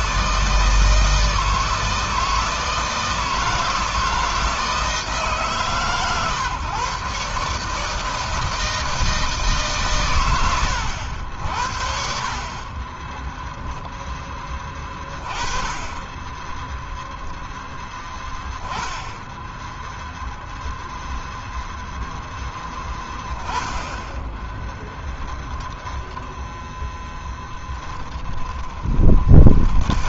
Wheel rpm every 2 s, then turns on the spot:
160, 160, 160, 130, 160, 100, 30, 20, 10, 10, 0, 10, 20, 10, 20.
12-14 16-18 24-26 28-30